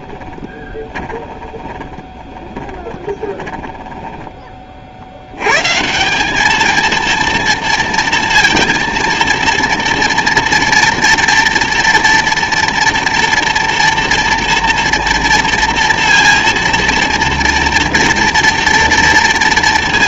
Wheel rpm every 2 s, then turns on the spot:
20, 30, 20, 200, 230, 230, 230, 230, 230, 230.
0-4